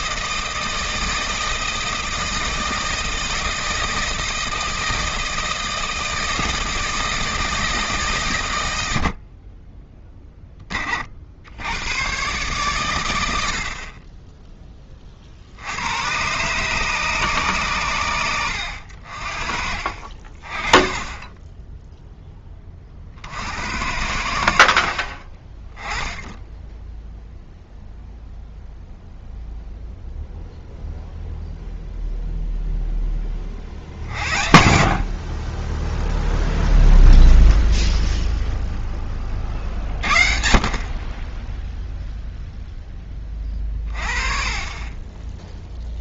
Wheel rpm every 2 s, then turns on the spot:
160, 160, 160, 160, 110, 20, 120, 10, 130, 80, 30, 20, 70, 10, 0, 0, 0, 50, 0, 0, 50, 0, 20.
none